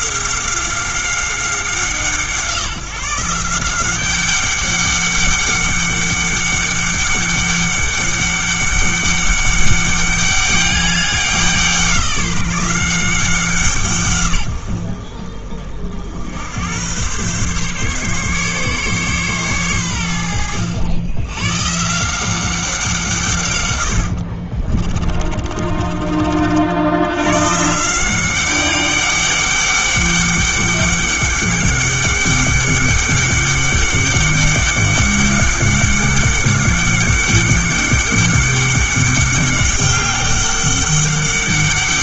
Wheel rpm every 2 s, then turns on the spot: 190, 170, 200, 200, 200, 200, 180, 90, 100, 140, 90, 180, 30, 70, 190, 200, 200, 200, 200, 200, 200.
24-26